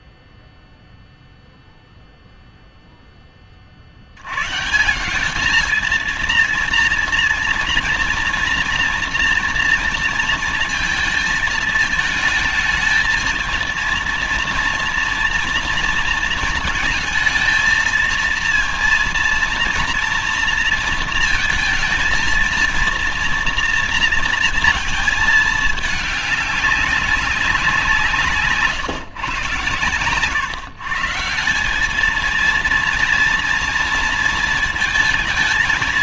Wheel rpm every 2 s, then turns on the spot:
0, 0, 110, 230, 230, 220, 220, 230, 230, 230, 230, 230, 230, 210, 150, 130, 230, 230.
none